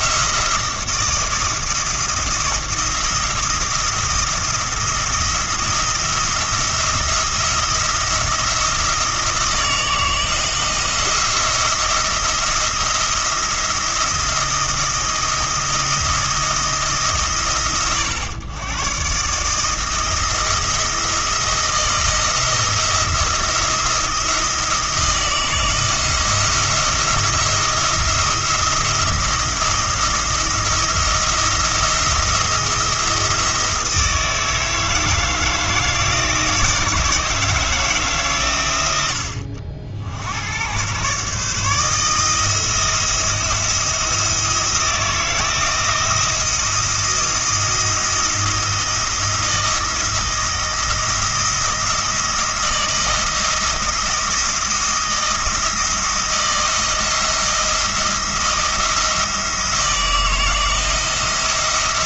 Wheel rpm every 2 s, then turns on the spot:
170, 170, 170, 170, 170, 160, 170, 170, 160, 120, 160, 170, 170, 170, 170, 160, 170, 160, 160, 100, 110, 170, 160, 170, 170, 170, 160, 170, 170, 170, 160.
none